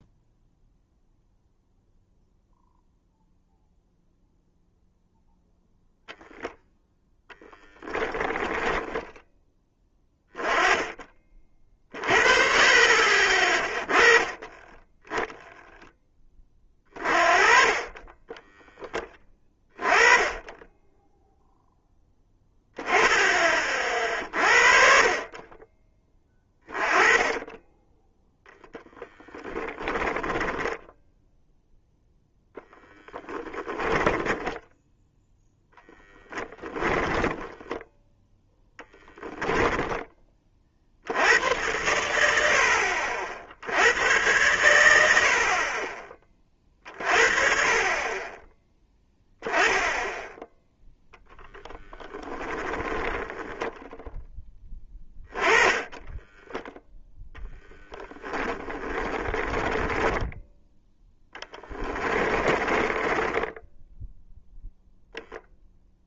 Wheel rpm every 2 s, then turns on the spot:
0, 0, 0, 0, 10, 10, 30, 20, 20, 10, 10, 20, 40, 20, 0, 10, 0, 10, 10, 10, 40, 70, 90, 30, 10, 0, 10, 10, 0, 20, 20, 20, 0.
8-10 34-40 58-64